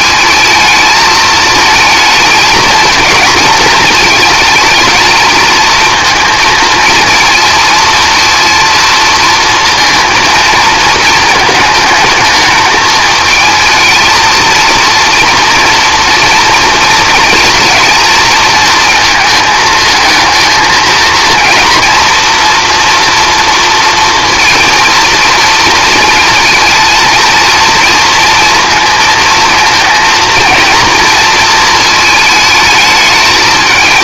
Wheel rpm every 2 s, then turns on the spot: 220, 230, 220, 230, 230, 230, 220, 230, 230, 230, 230, 240, 230, 230, 230, 230, 220.
none